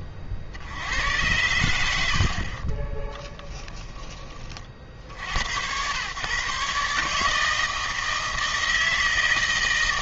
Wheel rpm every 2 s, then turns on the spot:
80, 40, 50, 140, 160.
2-4